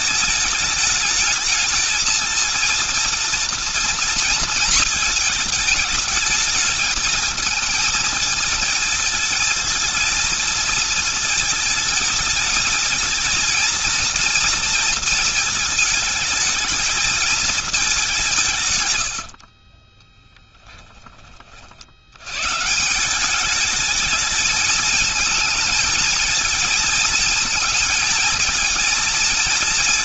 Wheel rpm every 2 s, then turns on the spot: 220, 230, 230, 220, 230, 230, 220, 230, 220, 130, 10, 150, 220, 220, 220.
18-20